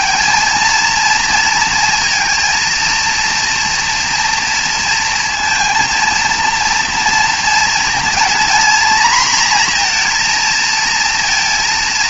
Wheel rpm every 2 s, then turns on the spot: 230, 230, 240, 230, 240, 230.
none